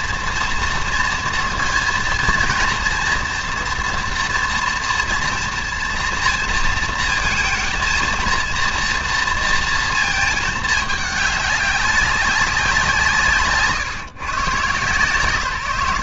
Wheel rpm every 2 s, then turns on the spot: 230, 230, 230, 230, 230, 210, 180, 140.
none